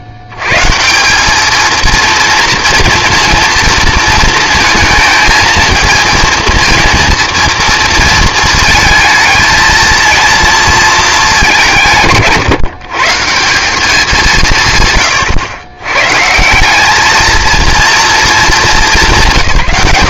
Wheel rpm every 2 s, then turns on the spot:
110, 230, 220, 230, 220, 220, 130, 160, 200, 130.
none